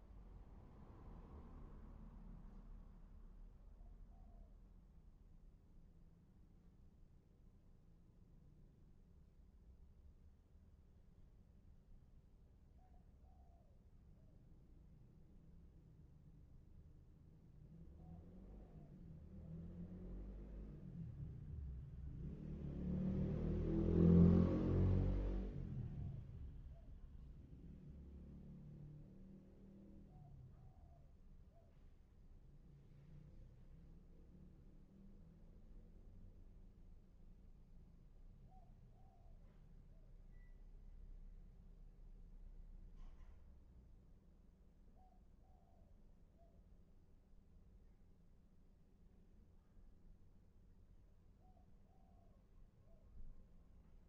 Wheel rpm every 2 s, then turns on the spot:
0, 0, 0, 0, 0, 0, 0, 0, 0, 0, 0, 0, 0, 0, 0, 0, 0, 0, 0, 0, 0, 0, 0, 0, 0, 0, 0.
none